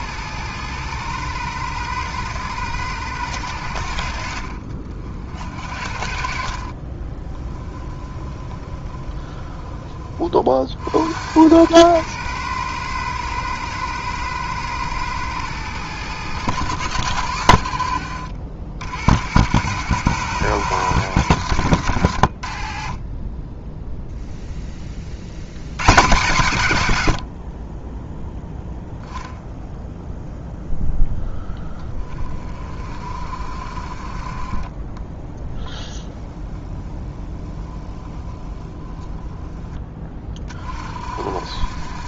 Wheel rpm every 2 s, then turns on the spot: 110, 100, 50, 30, 20, 70, 110, 110, 100, 90, 120, 30, 30, 110, 0, 0, 40, 20, 10, 10, 50.
6-10 34-38